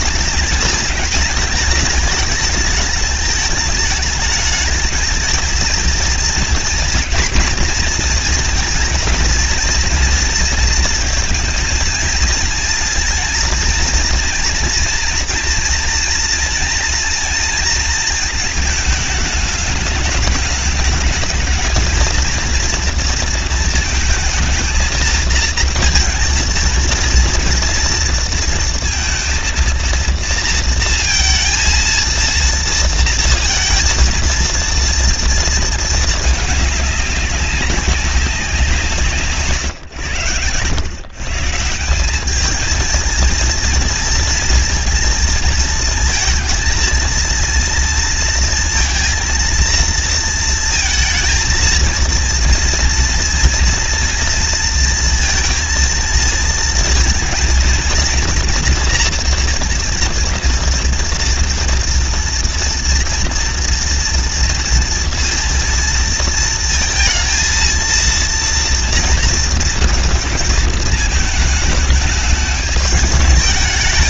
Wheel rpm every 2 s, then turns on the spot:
220, 210, 220, 230, 230, 230, 230, 230, 230, 220, 210, 230, 230, 230, 230, 230, 230, 230, 210, 190, 110, 210, 230, 220, 230, 230, 230, 230, 220, 230, 230, 230, 230, 230, 230, 230, 210.
none